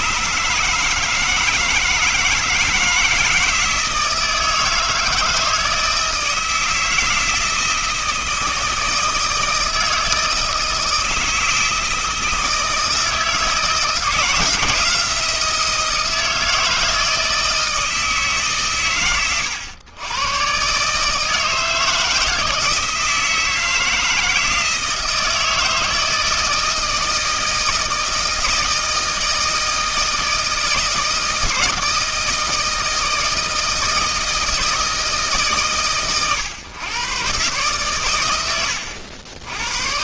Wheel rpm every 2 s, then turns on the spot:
150, 160, 160, 160, 160, 160, 160, 170, 160, 130, 130, 160, 160, 160, 160, 160, 160, 160, 120, 90.
none